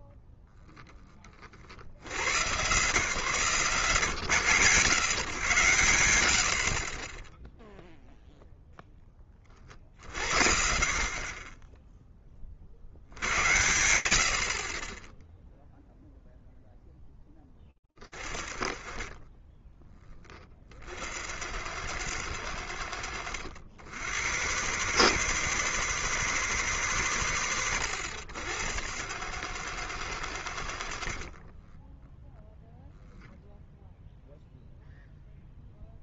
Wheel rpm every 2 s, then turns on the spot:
10, 130, 130, 40, 0, 50, 50, 20, 10, 40, 60, 90, 90, 110, 100, 60, 0, 0.
18-20 30-32